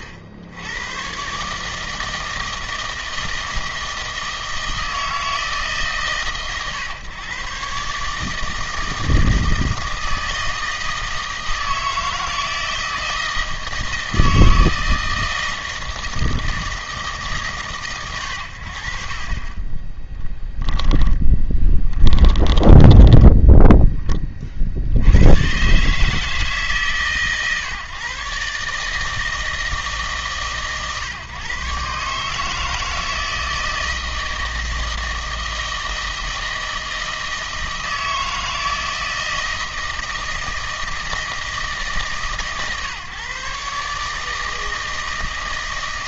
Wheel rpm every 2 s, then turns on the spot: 80, 160, 160, 120, 160, 160, 160, 160, 160, 90, 10, 10, 60, 140, 150, 130, 160, 160, 160, 160, 160, 140, 160.
20-24